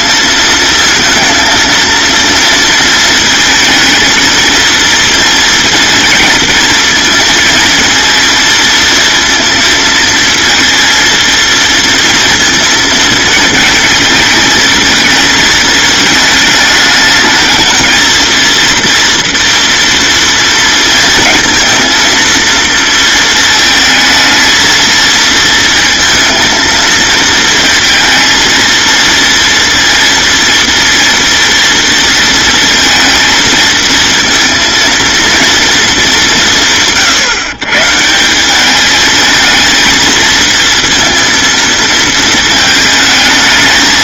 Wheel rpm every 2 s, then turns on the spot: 220, 230, 230, 230, 230, 230, 230, 220, 220, 230, 230, 230, 220, 230, 230, 230, 230, 230, 150, 200, 230, 220.
none